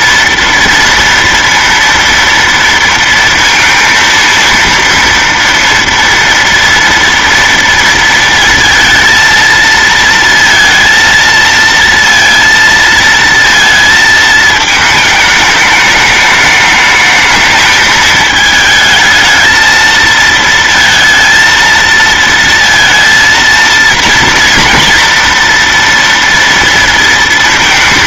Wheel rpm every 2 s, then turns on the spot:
230, 230, 230, 240, 230, 230, 230, 220, 210, 220, 230, 230, 230, 230.
none